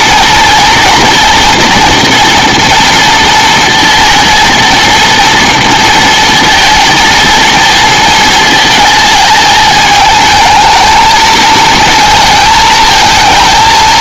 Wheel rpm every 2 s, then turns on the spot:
240, 230, 230, 230, 220, 220, 220.
none